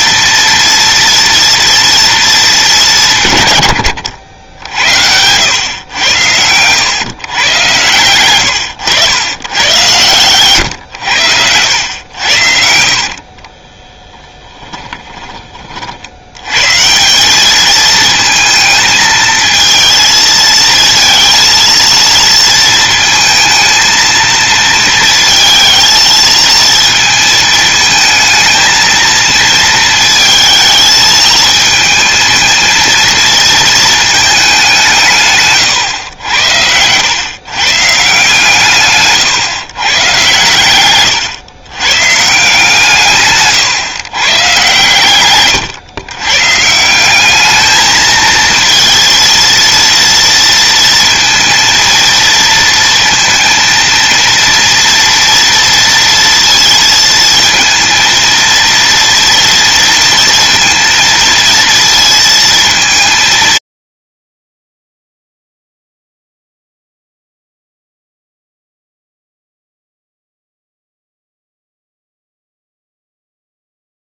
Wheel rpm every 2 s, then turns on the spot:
230, 180, 90, 110, 100, 110, 60, 20, 170, 220, 230, 220, 220, 230, 220, 220, 230, 160, 110, 140, 110, 150, 130, 180, 230, 230, 230, 230, 230, 230, 230, 220, 50, 0, 0, 0, 0.
12-14 38-40